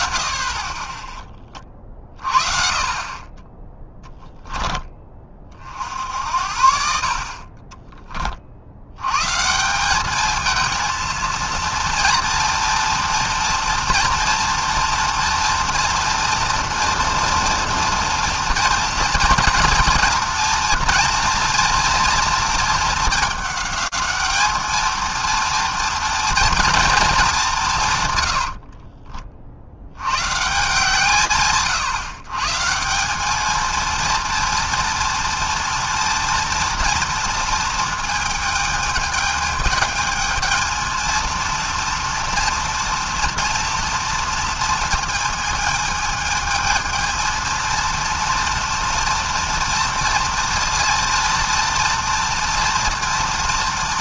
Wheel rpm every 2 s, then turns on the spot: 30, 30, 10, 70, 50, 220, 230, 230, 230, 240, 240, 230, 220, 230, 70, 130, 140, 230, 230, 220, 220, 230, 230, 220, 230, 230, 230.
28-30